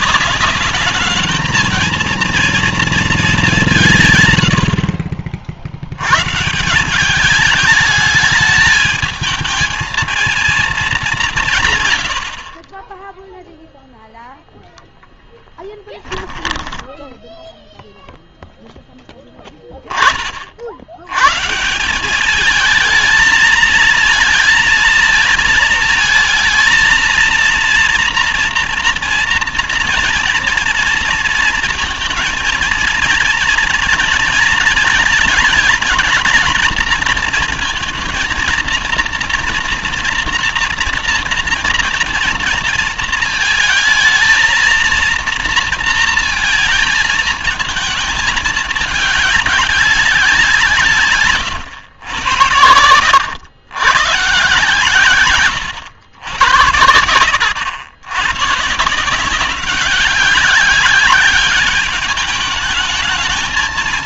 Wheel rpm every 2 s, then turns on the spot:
200, 230, 90, 150, 210, 220, 40, 0, 10, 0, 60, 210, 230, 220, 230, 240, 230, 230, 220, 230, 230, 230, 230, 220, 210, 160, 90, 140, 100, 130, 190, 210.
16-18